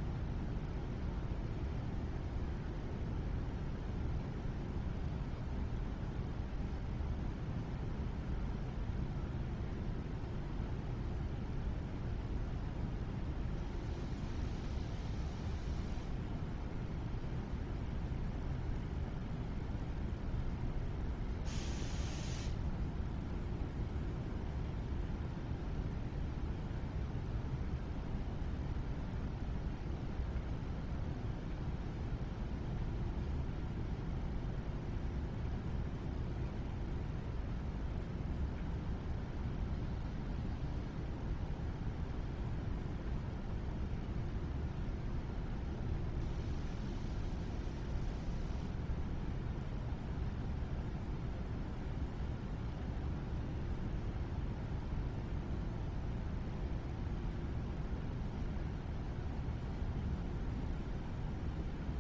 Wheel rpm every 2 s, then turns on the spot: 0, 0, 0, 0, 0, 0, 0, 0, 0, 0, 0, 0, 0, 0, 0, 0, 0, 0, 0, 0, 0, 0, 0, 0, 0, 0, 0, 0, 0, 0, 0.
none